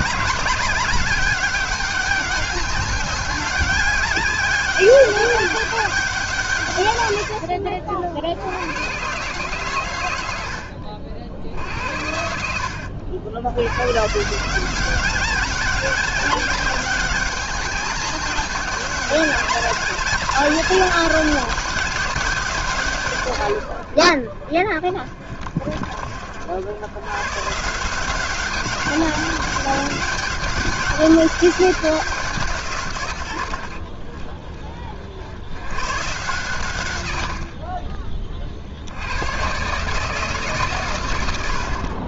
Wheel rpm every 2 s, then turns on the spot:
200, 200, 200, 110, 130, 60, 70, 200, 200, 200, 200, 140, 40, 120, 200, 200, 110, 60, 90, 100, 110.
none